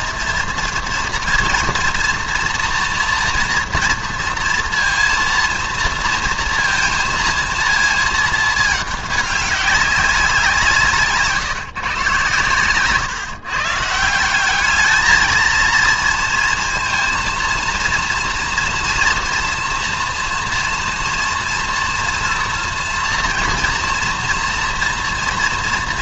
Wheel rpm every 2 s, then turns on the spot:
230, 230, 230, 230, 220, 170, 130, 210, 230, 240, 240, 240, 240.
none